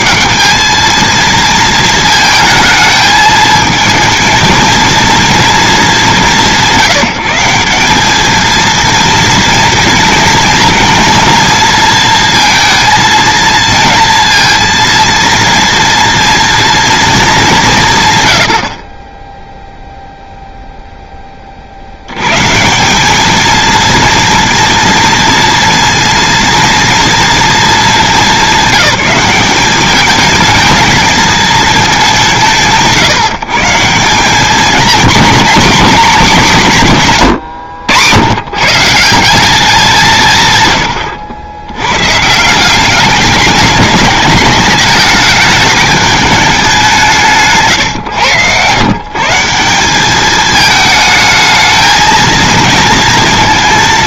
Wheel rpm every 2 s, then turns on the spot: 220, 220, 230, 160, 220, 220, 230, 230, 230, 50, 0, 180, 230, 240, 200, 220, 130, 210, 180, 150, 130, 180, 210, 200, 120, 220, 220.
none